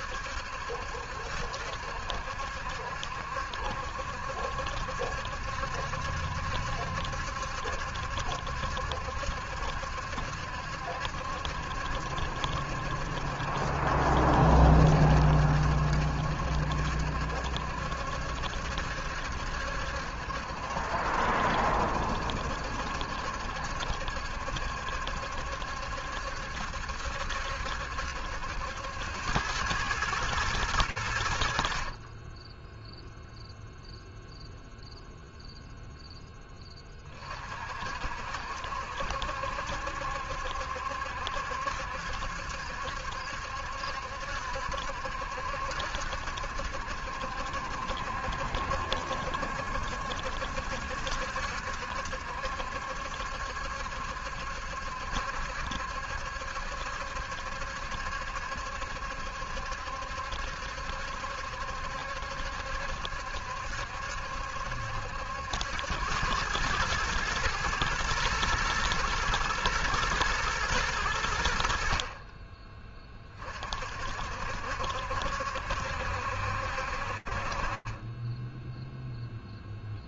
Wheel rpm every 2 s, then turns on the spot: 70, 60, 70, 70, 70, 70, 70, 70, 70, 70, 70, 70, 70, 70, 80, 110, 0, 0, 20, 70, 70, 70, 70, 70, 70, 70, 70, 70, 70, 70, 70, 70, 80, 110, 110, 80, 30, 70, 40, 0.
none